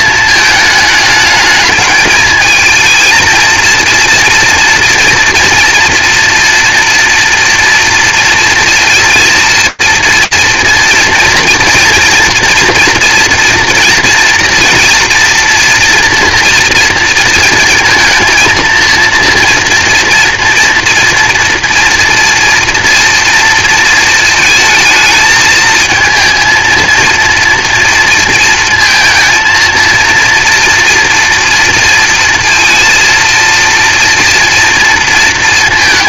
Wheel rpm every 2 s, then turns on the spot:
220, 220, 230, 230, 230, 230, 230, 230, 240, 230, 230, 230, 220, 230, 230, 230, 230, 230.
none